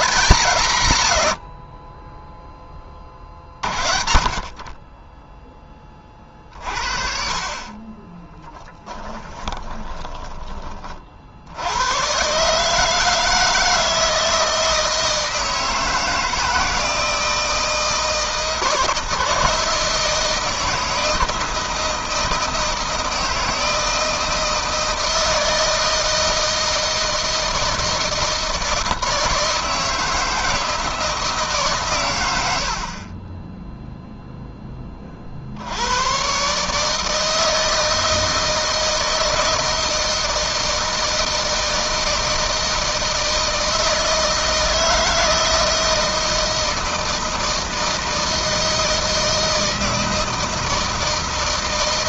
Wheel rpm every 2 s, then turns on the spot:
110, 30, 30, 50, 20, 40, 150, 160, 160, 160, 160, 160, 160, 160, 160, 160, 40, 30, 150, 160, 160, 160, 160, 160, 160, 160.
8-10